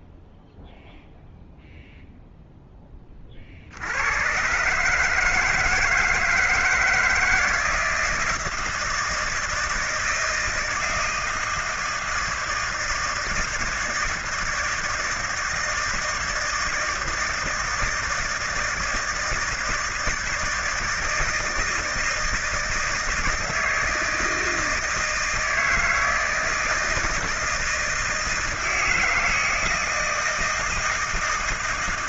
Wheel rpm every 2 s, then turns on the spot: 0, 10, 140, 160, 160, 160, 160, 160, 160, 160, 160, 160, 160, 160, 160, 160.
none